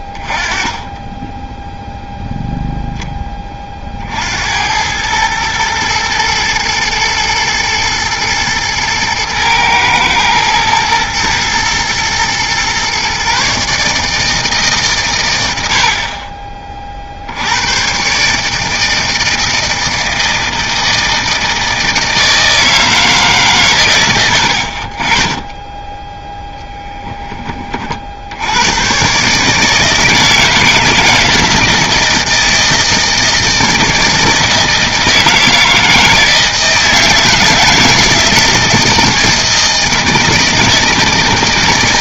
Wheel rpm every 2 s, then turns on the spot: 20, 20, 90, 110, 110, 110, 120, 150, 30, 160, 160, 160, 70, 0, 100, 160, 160, 160, 160, 160, 160.
none